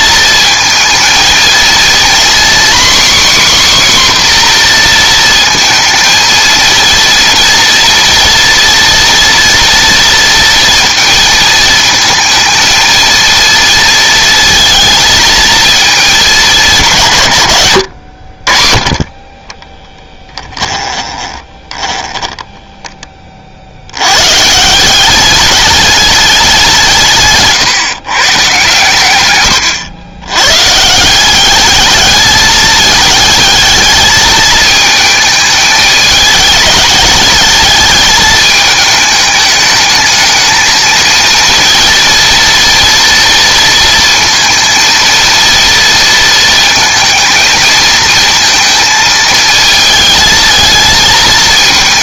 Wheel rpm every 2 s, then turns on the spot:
230, 270, 240, 230, 230, 230, 220, 220, 190, 60, 20, 10, 160, 170, 130, 130, 210, 220, 220, 210, 220, 230, 230, 230, 230, 220.
20-24